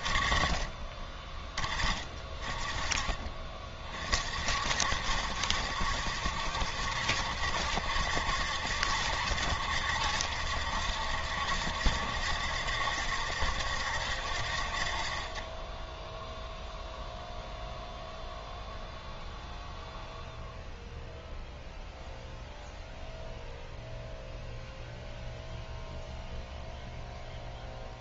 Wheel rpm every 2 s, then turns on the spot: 30, 30, 60, 70, 80, 70, 70, 50, 0, 0, 0, 0, 0, 0.
none